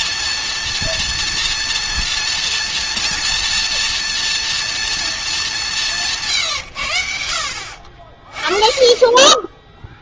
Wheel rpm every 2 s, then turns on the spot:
230, 230, 230, 140, 30.
none